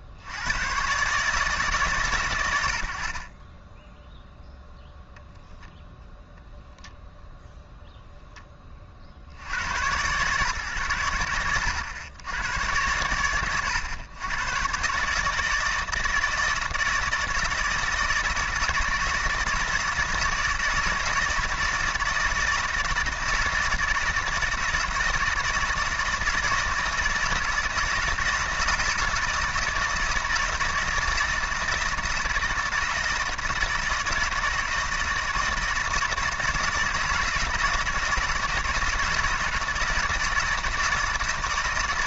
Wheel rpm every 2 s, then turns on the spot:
110, 90, 0, 0, 10, 110, 90, 120, 160, 160, 160, 160, 160, 160, 160, 160, 160, 160, 160, 160, 160.
none